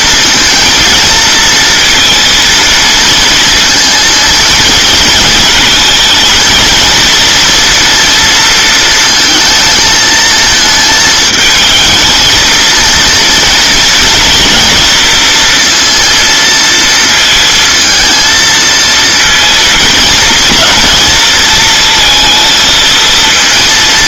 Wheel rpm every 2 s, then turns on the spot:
230, 230, 220, 230, 230, 220, 230, 230, 230, 230, 230, 230.
none